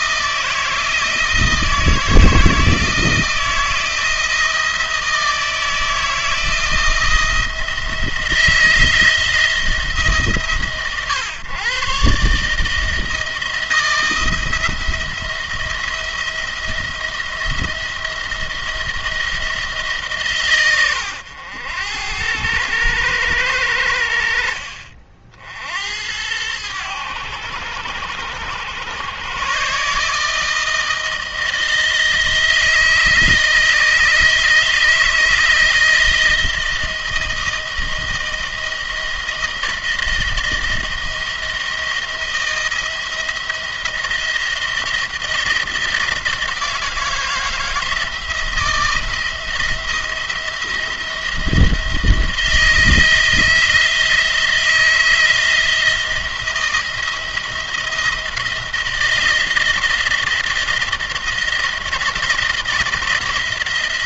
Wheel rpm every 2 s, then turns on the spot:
160, 160, 170, 170, 170, 140, 150, 160, 170, 170, 120, 100, 60, 90, 90, 160, 160, 160, 160, 160, 170, 170, 170, 160, 160, 170, 170, 170, 170, 170, 170, 170.
none